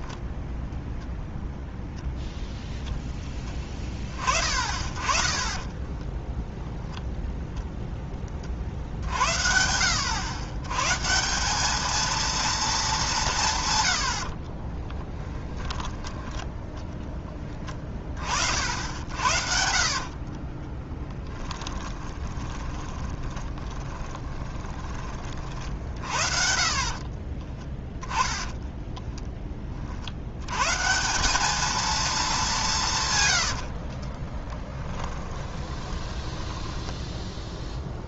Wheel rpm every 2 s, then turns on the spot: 0, 0, 30, 0, 30, 110, 220, 40, 20, 50, 30, 20, 20, 50, 20, 120, 200, 10, 10.
14-16 20-30 34-38